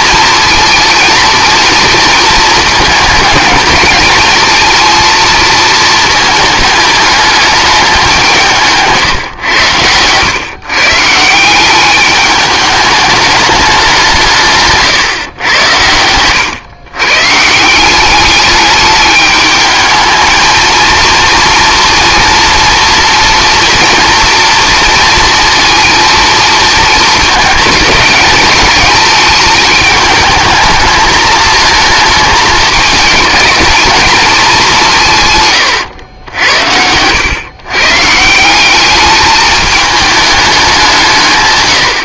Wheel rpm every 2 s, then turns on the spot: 230, 220, 220, 220, 150, 130, 210, 150, 120, 210, 230, 240, 230, 220, 220, 220, 220, 210, 80, 190, 190.
8-10 14-16